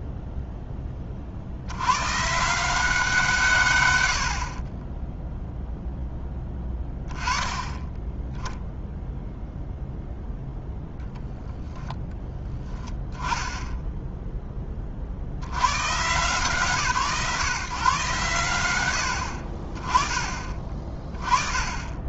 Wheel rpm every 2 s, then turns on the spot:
20, 170, 20, 10, 0, 0, 20, 20, 150, 90, 30.
4-6